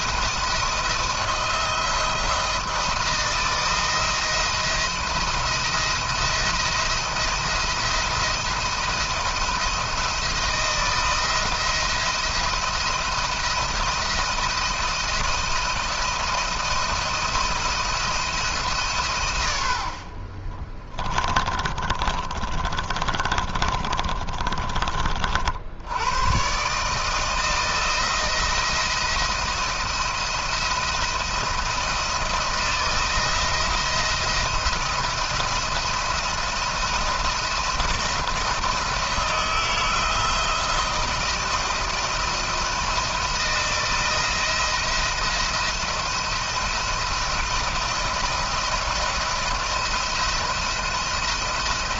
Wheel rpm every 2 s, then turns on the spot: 170, 170, 170, 170, 170, 170, 170, 170, 160, 150, 40, 30, 30, 140, 170, 170, 170, 170, 170, 160, 160, 170, 170, 160, 170, 170.
20-24